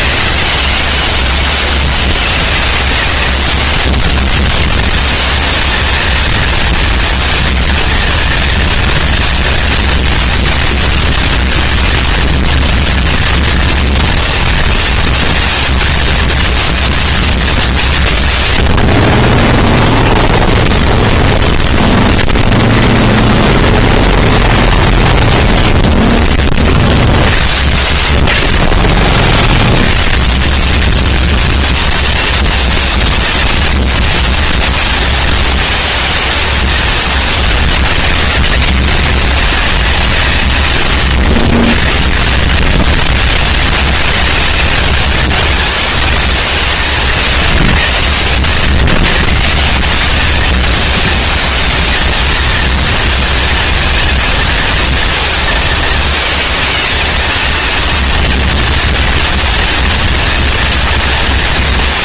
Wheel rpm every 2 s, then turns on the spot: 200, 200, 200, 230, 230, 230, 230, 230, 230, 130, 10, 20, 0, 20, 50, 150, 230, 230, 220, 180, 180, 80, 190, 190, 90, 200, 220, 230, 220, 230, 230.
20-24 48-50